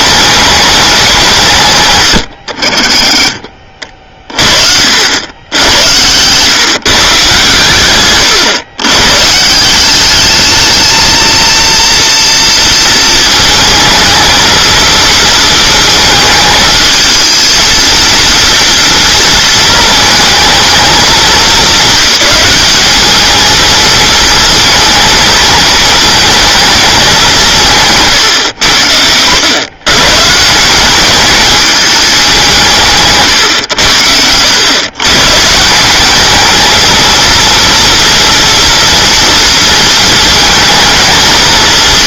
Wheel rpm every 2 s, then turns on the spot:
200, 70, 50, 140, 120, 220, 230, 230, 220, 230, 220, 200, 220, 220, 100, 170, 170, 120, 220, 230, 220.
none